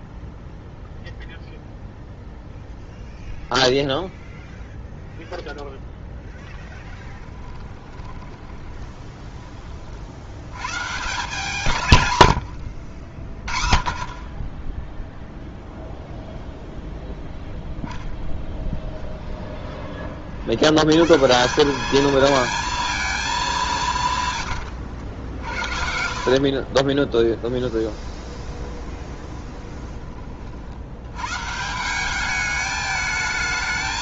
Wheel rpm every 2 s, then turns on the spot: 0, 0, 0, 10, 20, 130, 90, 10, 0, 10, 100, 230, 100, 30, 20, 80, 210.
6-10 12-14 18-20 24-30